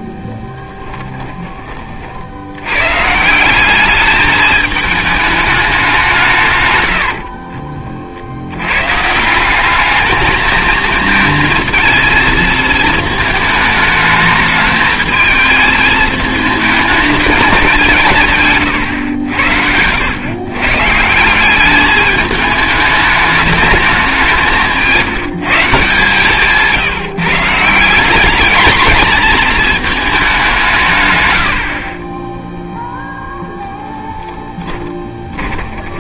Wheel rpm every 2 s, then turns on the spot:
10, 90, 220, 130, 100, 220, 220, 220, 220, 140, 130, 210, 190, 160, 220, 180, 0, 10.
0-2 34-36